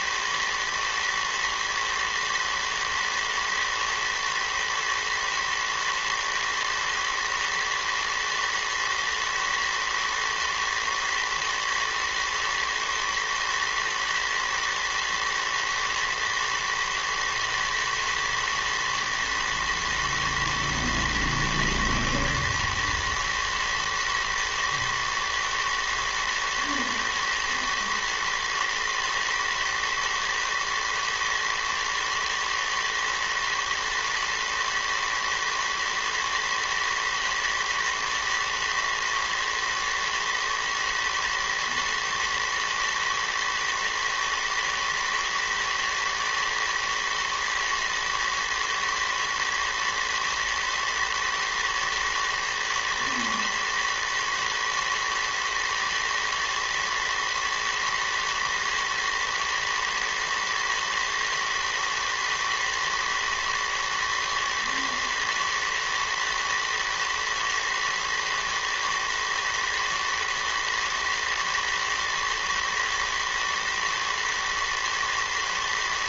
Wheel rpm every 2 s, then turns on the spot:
110, 110, 110, 110, 110, 110, 110, 110, 110, 110, 120, 120, 110, 110, 120, 110, 110, 120, 110, 110, 110, 120, 110, 110, 110, 110, 110, 110, 120, 110, 110, 110, 110, 110, 110, 120, 110, 110.
none